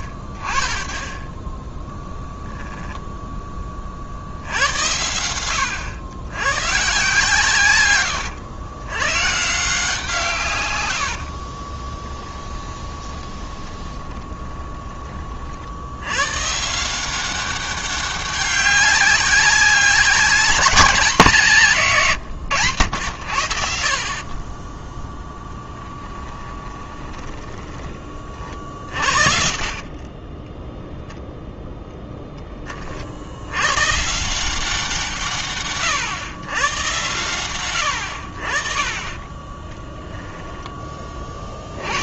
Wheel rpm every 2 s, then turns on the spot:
30, 0, 80, 110, 100, 130, 20, 20, 150, 200, 200, 110, 20, 20, 40, 10, 20, 180, 110, 50, 10.
12-14 26-28